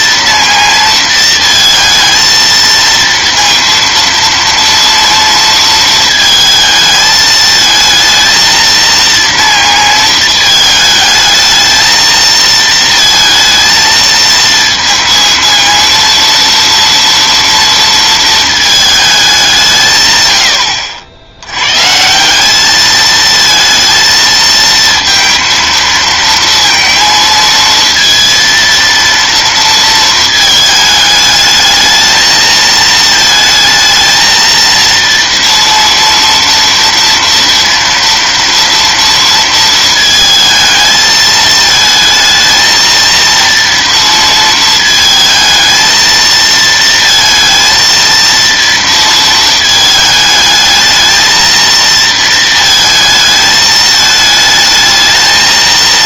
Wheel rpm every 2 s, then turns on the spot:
230, 230, 230, 220, 220, 220, 220, 220, 230, 220, 110, 170, 230, 230, 230, 220, 220, 230, 230, 230, 220, 220, 230, 230, 230, 220, 230, 220.
none